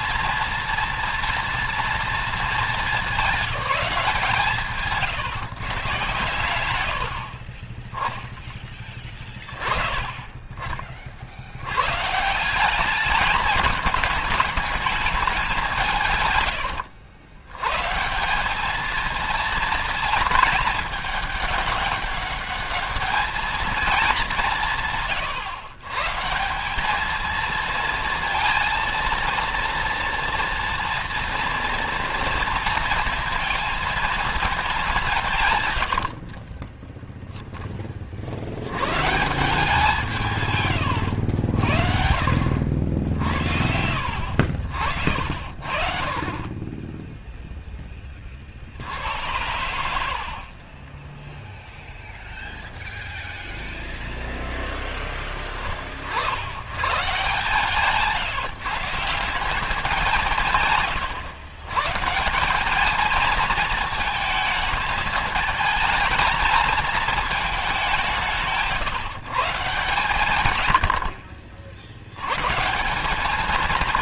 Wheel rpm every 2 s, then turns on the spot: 230, 210, 140, 90, 20, 40, 190, 210, 100, 220, 220, 210, 160, 190, 230, 230, 230, 190, 10, 120, 110, 60, 70, 10, 70, 10, 0, 10, 110, 160, 130, 200, 220, 220, 150, 90, 170.
16-18 36-38 50-52